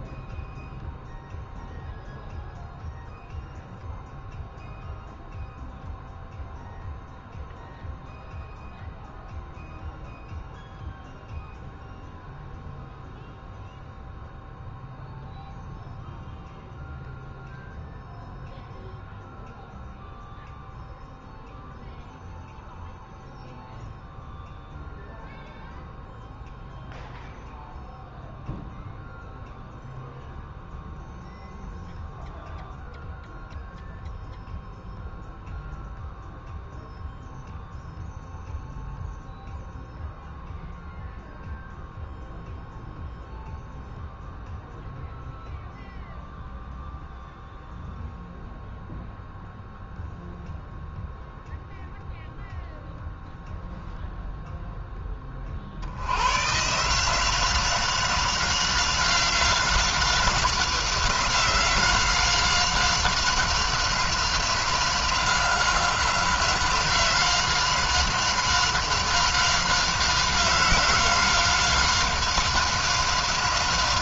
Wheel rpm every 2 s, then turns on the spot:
0, 0, 0, 0, 0, 0, 0, 0, 0, 0, 0, 0, 0, 0, 0, 0, 0, 0, 0, 0, 0, 0, 0, 0, 0, 0, 0, 10, 150, 190, 180, 190, 180, 190, 190, 180, 190.
none